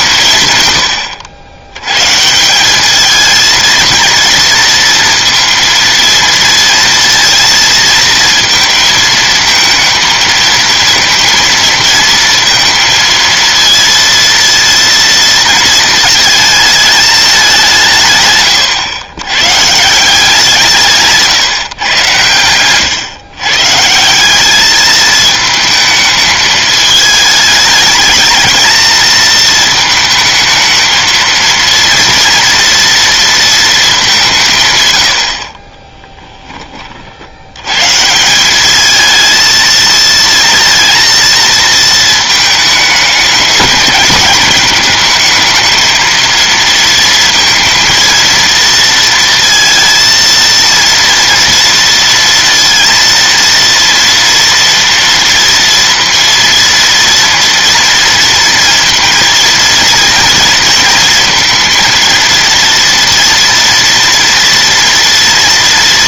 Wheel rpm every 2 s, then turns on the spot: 120, 200, 230, 230, 230, 230, 230, 230, 220, 110, 160, 110, 210, 210, 220, 220, 240, 140, 30, 200, 230, 210, 220, 230, 230, 230, 230, 230, 230, 230, 230, 230, 230.
none